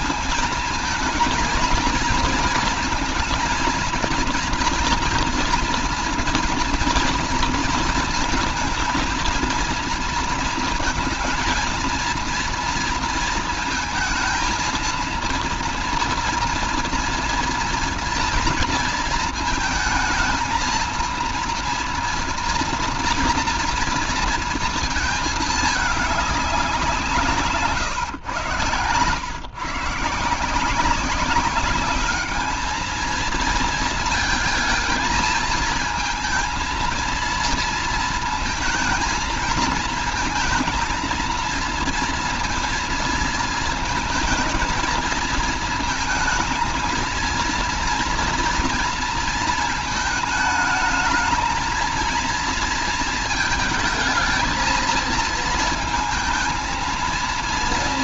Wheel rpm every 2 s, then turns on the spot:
230, 220, 230, 230, 230, 230, 230, 230, 230, 230, 230, 230, 220, 170, 120, 190, 220, 230, 230, 220, 220, 230, 230, 230, 230, 220, 220, 220, 230.
none